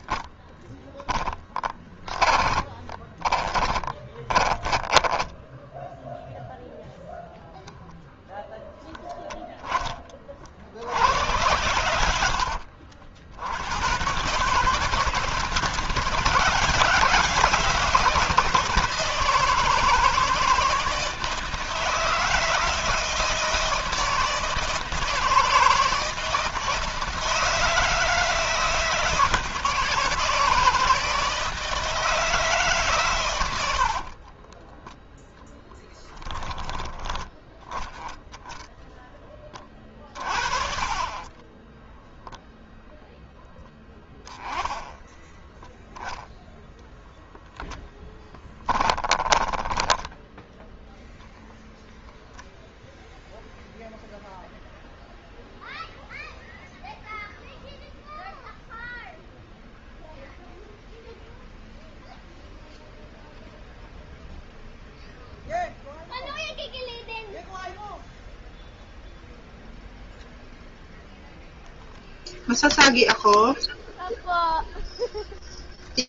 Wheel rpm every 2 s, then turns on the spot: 10, 20, 20, 0, 0, 40, 70, 140, 160, 160, 160, 160, 160, 160, 160, 160, 150, 20, 10, 0, 40, 0, 10, 0, 10, 0, 0, 0, 0, 0, 0, 0, 0, 0, 0, 0, 0, 0.
2-6 34-36 40-42 48-50